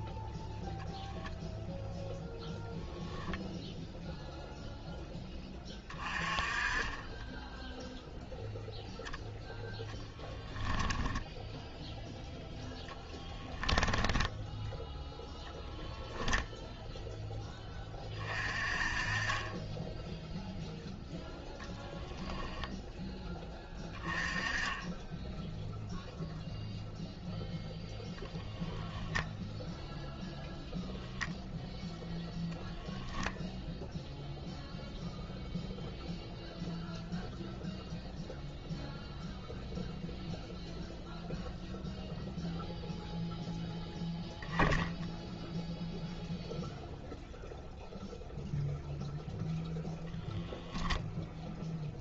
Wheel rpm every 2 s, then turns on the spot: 0, 0, 0, 20, 0, 10, 10, 10, 0, 30, 0, 10, 20, 0, 0, 0, 0, 0, 0, 0, 0, 0, 0, 0, 0, 10.
10-14 22-24